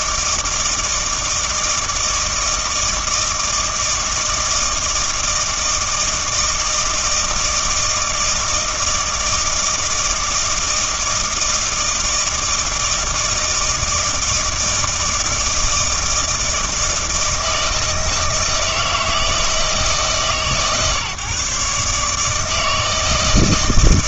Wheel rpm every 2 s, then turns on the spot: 160, 160, 160, 160, 160, 160, 160, 160, 160, 160, 140, 160.
none